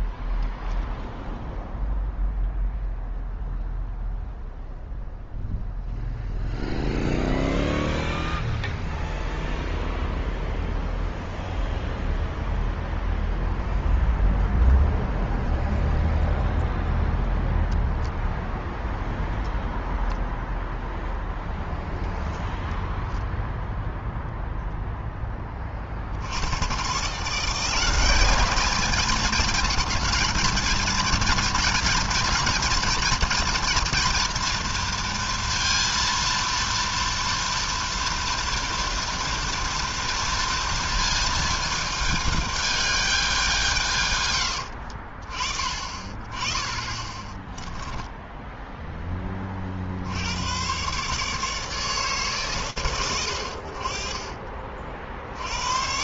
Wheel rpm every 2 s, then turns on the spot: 0, 0, 0, 0, 0, 0, 0, 0, 0, 0, 0, 0, 10, 170, 230, 230, 240, 230, 230, 230, 220, 190, 40, 20, 20, 140, 80, 70.
46-48